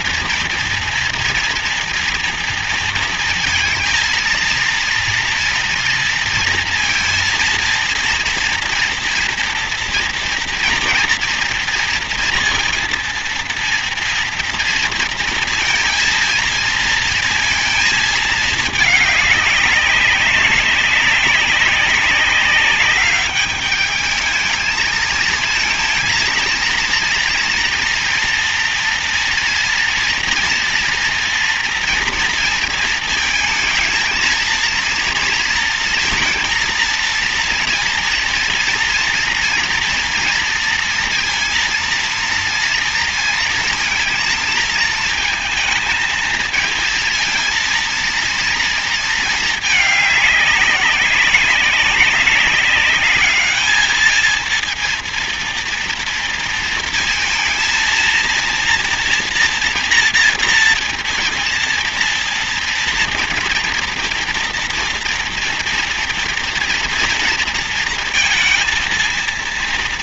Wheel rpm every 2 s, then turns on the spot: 230, 230, 230, 230, 230, 230, 230, 230, 230, 220, 190, 200, 220, 230, 240, 230, 230, 230, 230, 230, 230, 230, 220, 230, 230, 200, 200, 230, 230, 230, 230, 230, 230, 230, 230.
none